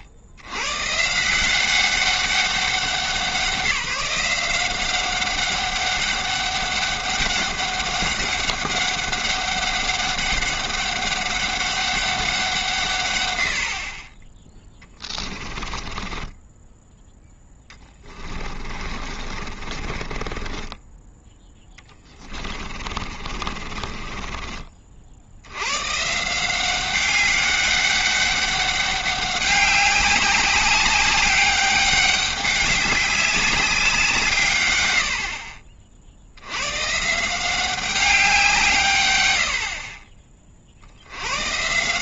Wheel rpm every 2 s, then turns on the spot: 100, 180, 180, 200, 200, 200, 180, 20, 10, 30, 20, 30, 30, 190, 200, 190, 200, 120, 110, 160, 60.
16-24